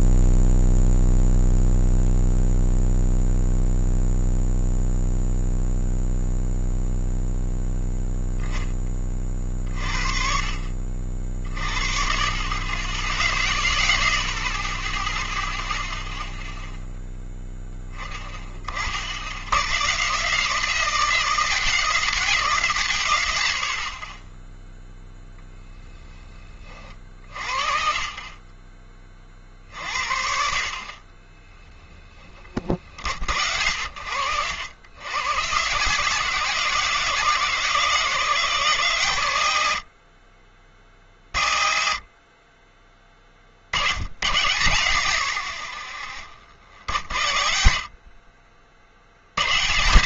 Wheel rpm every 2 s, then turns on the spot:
0, 0, 0, 0, 20, 60, 30, 0, 0, 40, 170, 160, 0, 30, 30, 50, 60, 100, 170, 160, 50, 30, 80, 60, 60.
28-30